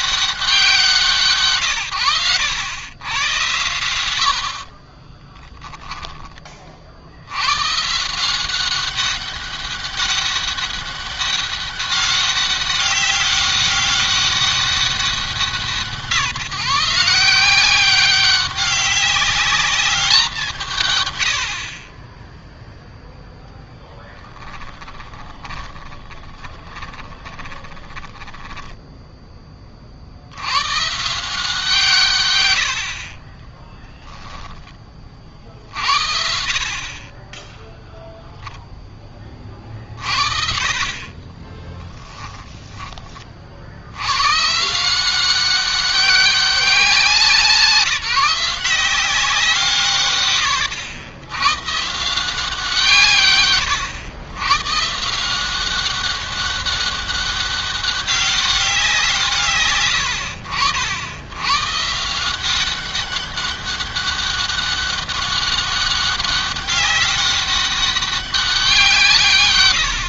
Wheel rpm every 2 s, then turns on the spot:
180, 100, 40, 60, 190, 200, 200, 200, 160, 200, 140, 0, 20, 20, 10, 130, 70, 20, 40, 10, 40, 20, 160, 190, 190, 90, 160, 140, 200, 180, 80, 190, 200, 200, 170.
4-6 24-30